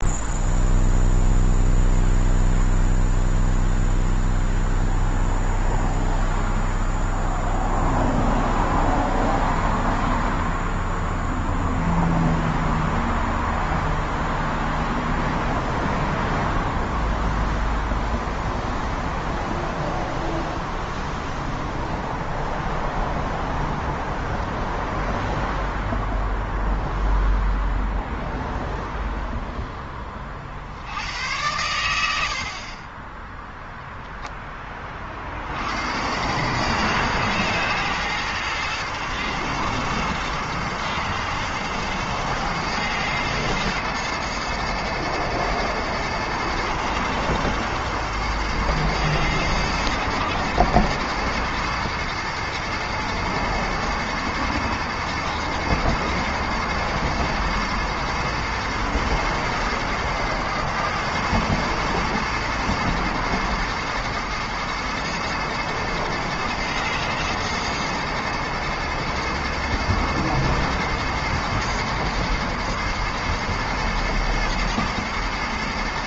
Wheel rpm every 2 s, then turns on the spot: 0, 0, 0, 0, 0, 0, 0, 0, 0, 0, 0, 0, 0, 0, 0, 70, 30, 30, 120, 120, 110, 120, 110, 110, 110, 110, 110, 110, 110, 110, 110, 120, 110, 110, 110, 110, 110, 110.
none